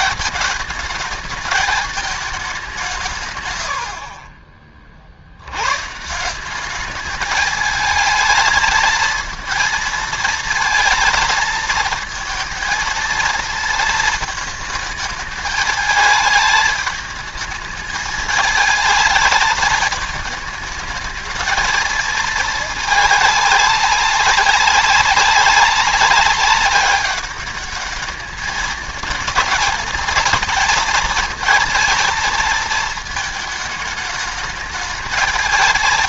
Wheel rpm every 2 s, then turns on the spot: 210, 190, 40, 190, 220, 230, 230, 220, 210, 220, 220, 220, 200, 200, 210, 230, 230, 220.
none